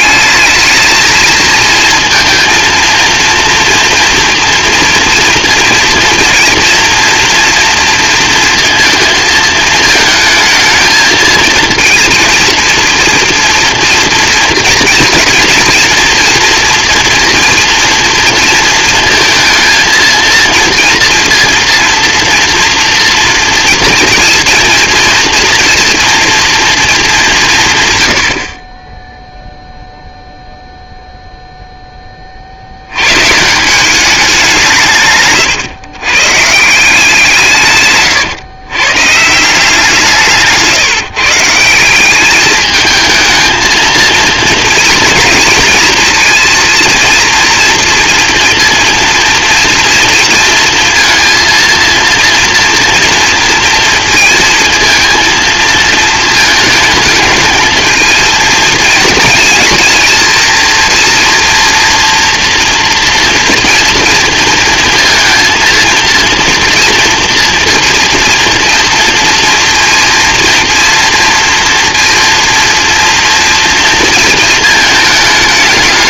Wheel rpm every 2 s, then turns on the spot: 220, 230, 230, 230, 220, 220, 230, 230, 230, 230, 230, 230, 240, 210, 10, 0, 60, 180, 150, 120, 150, 210, 230, 230, 230, 230, 230, 230, 220, 230, 230, 230, 230, 230, 240, 230, 230, 220.
40-42